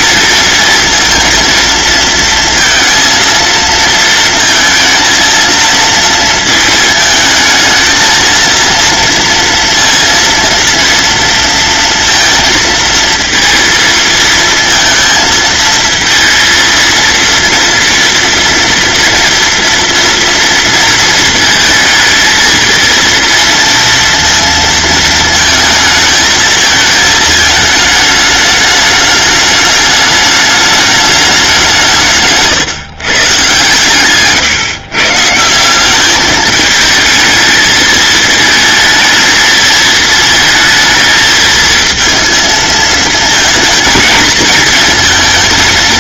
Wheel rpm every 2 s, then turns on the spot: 230, 230, 230, 220, 230, 230, 230, 230, 230, 230, 230, 230, 230, 220, 210, 210, 140, 140, 220, 220, 220, 220, 230.
none